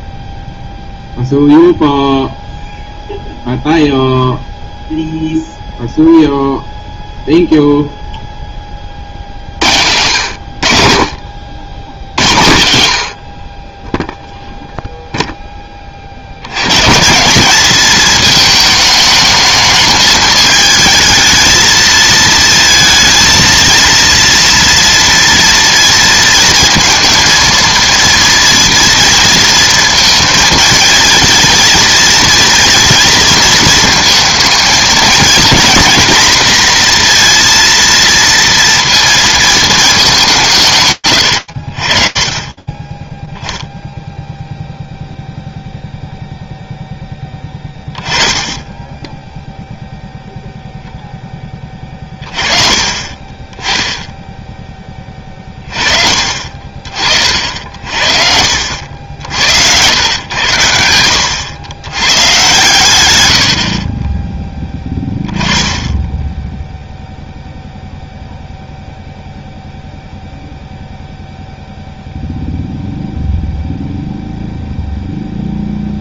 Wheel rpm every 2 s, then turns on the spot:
0, 0, 0, 0, 20, 70, 90, 0, 110, 220, 220, 230, 230, 230, 230, 230, 230, 220, 230, 230, 110, 20, 0, 0, 10, 0, 30, 20, 40, 80, 90, 110, 10, 0, 0, 0, 0, 0.
none